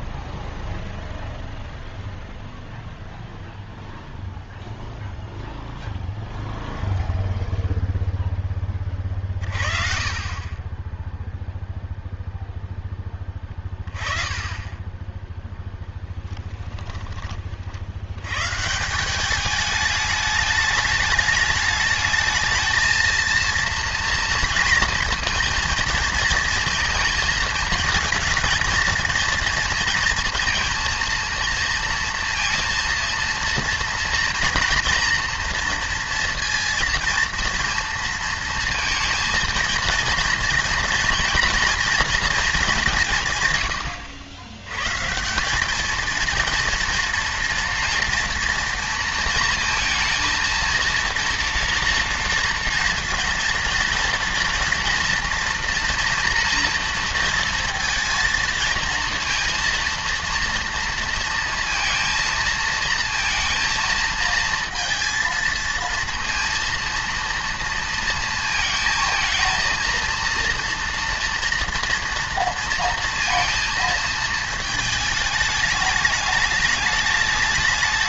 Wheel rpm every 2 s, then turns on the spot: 0, 0, 0, 0, 20, 20, 10, 20, 10, 150, 210, 220, 230, 230, 230, 230, 230, 230, 230, 230, 240, 200, 110, 230, 230, 230, 230, 240, 230, 230, 230, 230, 230, 230, 220, 230, 230, 220, 210.
14-18